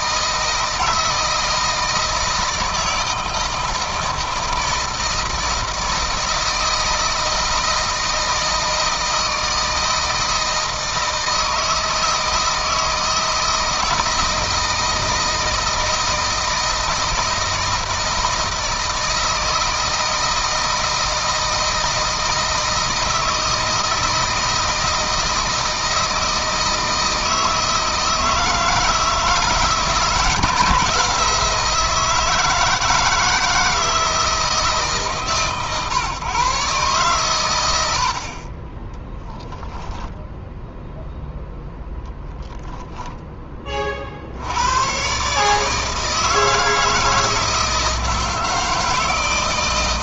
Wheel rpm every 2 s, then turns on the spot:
160, 160, 160, 160, 160, 160, 160, 160, 160, 160, 160, 160, 160, 160, 160, 170, 160, 150, 130, 10, 0, 10, 110, 160, 160.
38-40